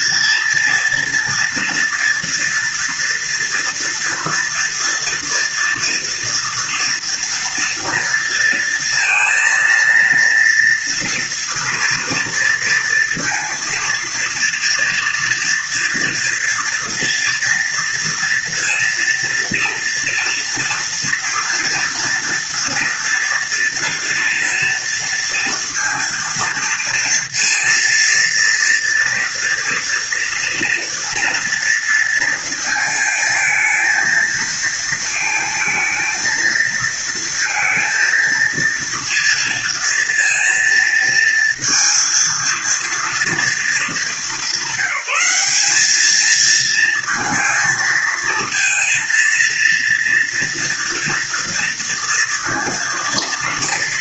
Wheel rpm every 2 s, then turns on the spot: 230, 230, 230, 230, 230, 230, 230, 230, 230, 230, 230, 230, 230, 230, 230, 230, 220, 230, 230, 230, 230, 230, 190, 230, 230, 230, 230.
none